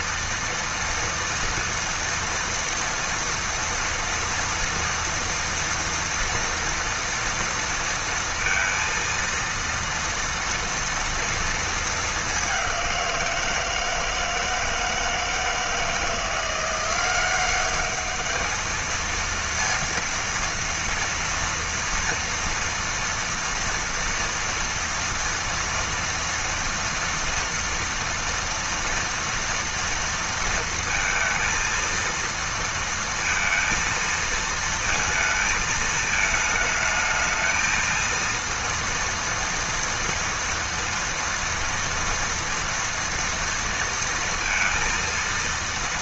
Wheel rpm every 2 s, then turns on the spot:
230, 230, 230, 230, 230, 230, 210, 160, 170, 210, 230, 230, 230, 230, 230, 230, 230, 230, 220, 230, 230, 230, 230.
none